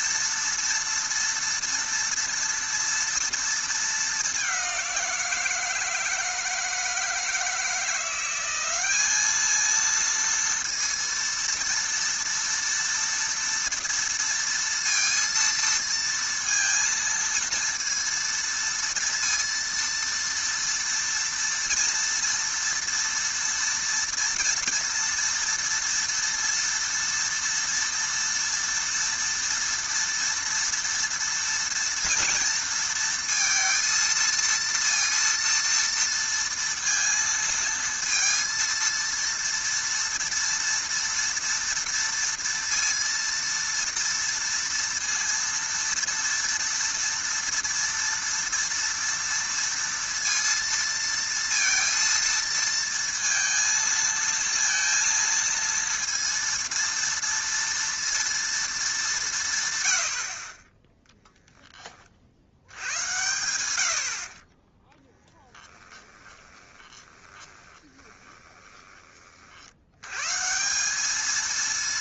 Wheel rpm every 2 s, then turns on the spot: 230, 230, 190, 160, 190, 230, 230, 230, 230, 230, 230, 230, 230, 240, 240, 230, 230, 230, 230, 230, 230, 230, 230, 240, 230, 230, 230, 230, 230, 220, 20, 80, 30, 20, 20, 170.
66-70